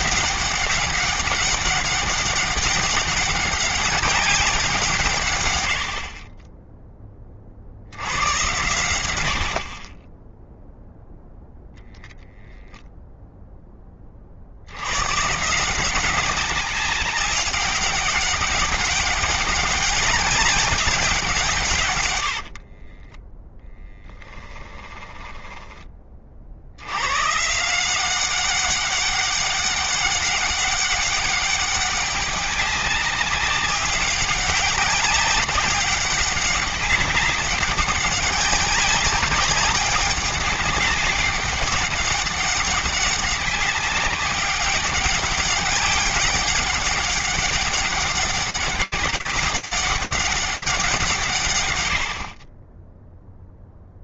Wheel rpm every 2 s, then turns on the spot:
200, 200, 180, 30, 90, 10, 0, 50, 190, 200, 200, 80, 10, 50, 190, 200, 200, 200, 200, 200, 200, 200, 200, 200, 190, 190, 40.
22-26